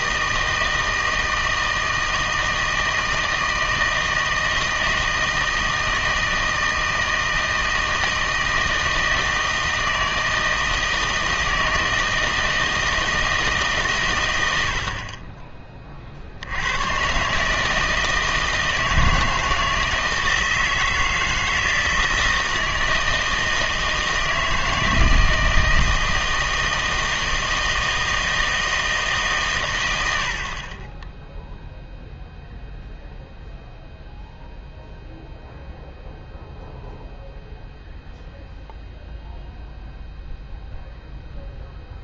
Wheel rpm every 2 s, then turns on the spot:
160, 160, 160, 160, 160, 160, 160, 80, 90, 160, 160, 160, 160, 160, 160, 40, 0, 0, 0, 0, 0.
none